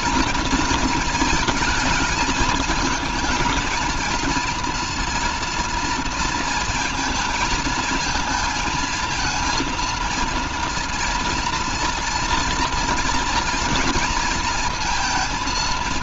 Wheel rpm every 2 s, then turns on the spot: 230, 220, 230, 230, 220, 230, 230, 230.
none